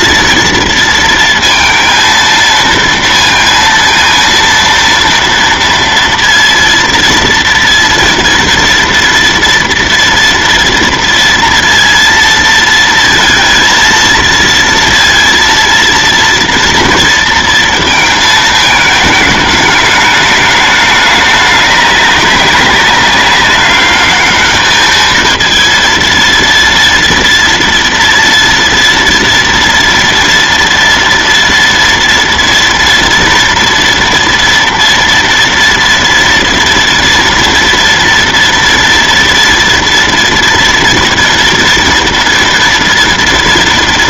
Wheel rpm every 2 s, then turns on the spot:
230, 230, 230, 230, 230, 240, 230, 230, 230, 210, 210, 200, 210, 230, 230, 230, 230, 230, 230, 240, 240, 230.
none